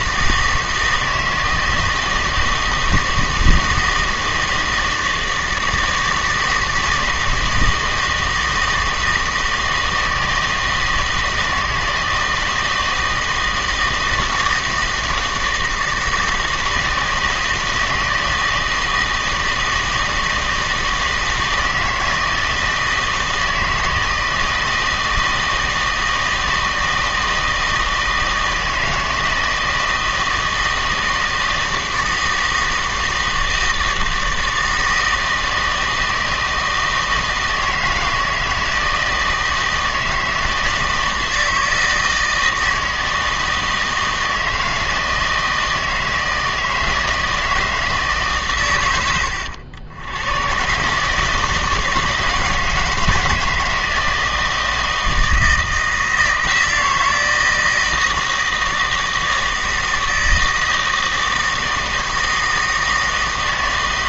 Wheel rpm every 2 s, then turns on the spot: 160, 160, 160, 160, 160, 160, 160, 160, 160, 160, 160, 160, 160, 160, 160, 160, 160, 160, 160, 160, 160, 160, 160, 160, 120, 130, 160, 160, 170, 160, 160, 160.
none